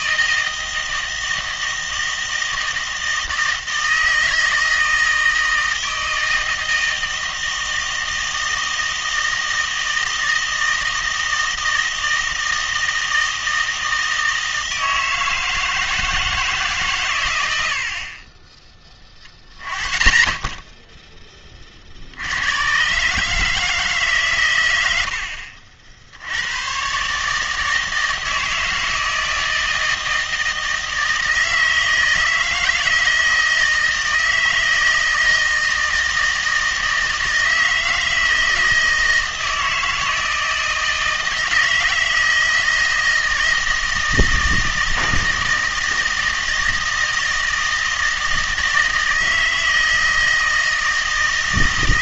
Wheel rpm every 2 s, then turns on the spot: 160, 160, 160, 160, 160, 160, 160, 160, 140, 20, 10, 120, 90, 120, 160, 160, 160, 160, 160, 160, 160, 160, 160, 160, 160, 160.
none